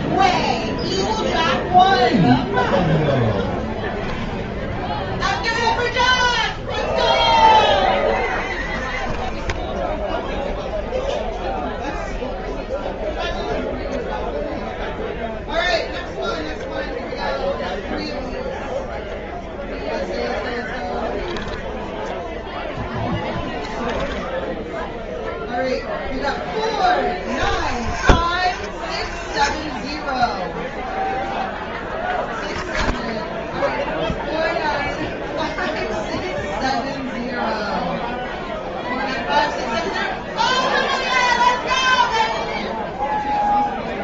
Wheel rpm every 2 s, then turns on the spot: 0, 0, 20, 0, 30, 0, 0, 0, 0, 0, 10, 10, 10, 20, 40, 0, 0, 0, 0, 0, 0, 0.
4-6 20-24